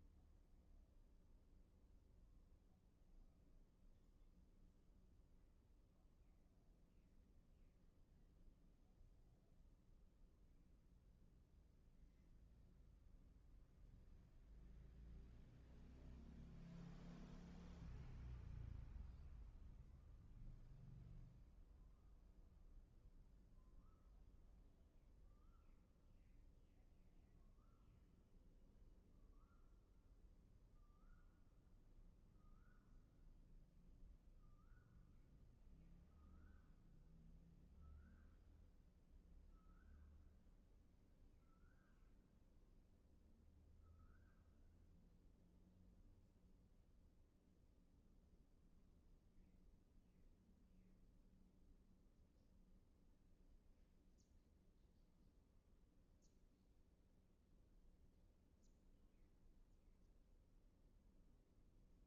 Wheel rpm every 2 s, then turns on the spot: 0, 0, 0, 0, 0, 0, 0, 0, 0, 0, 0, 0, 0, 0, 0, 0, 0, 0, 0, 0, 0, 0, 0, 0, 0, 0, 0, 0, 0, 0, 0.
none